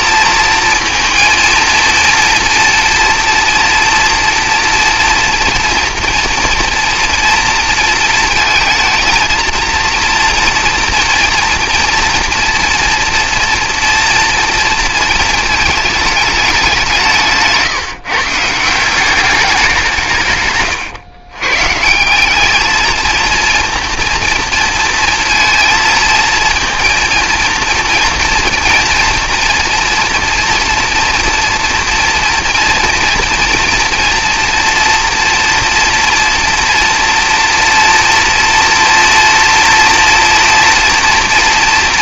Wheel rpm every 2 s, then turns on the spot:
230, 230, 240, 230, 230, 230, 230, 230, 190, 170, 130, 220, 230, 230, 230, 240, 230, 230, 230, 230, 230.
none